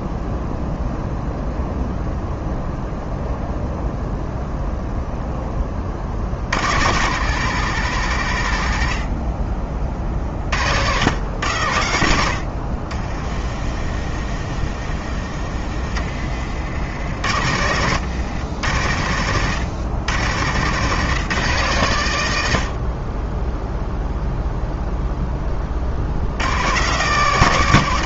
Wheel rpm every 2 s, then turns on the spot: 0, 0, 0, 60, 80, 60, 60, 30, 50, 100, 120, 80, 0, 120.
16-18